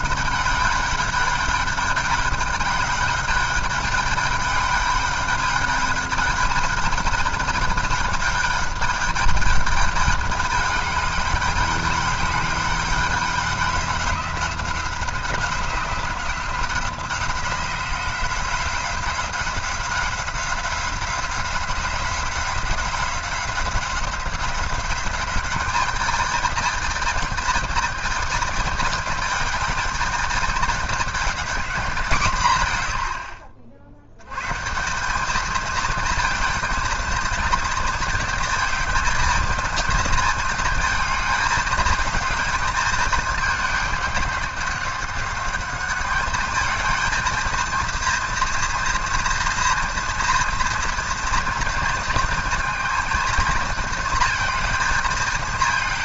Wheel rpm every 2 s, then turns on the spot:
200, 200, 200, 200, 200, 200, 200, 180, 180, 180, 180, 180, 190, 210, 210, 210, 90, 180, 220, 230, 230, 220, 200, 220, 230, 230, 230, 220.
none